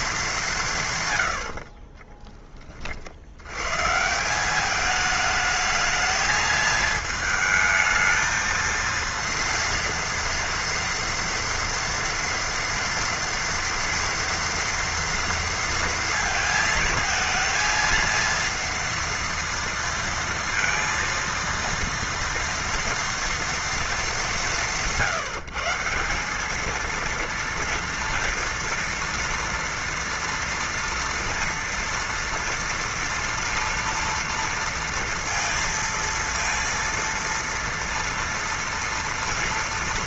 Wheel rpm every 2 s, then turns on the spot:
170, 20, 200, 220, 220, 230, 230, 230, 230, 230, 230, 230, 180, 210, 230, 230, 230, 230, 230, 230.
none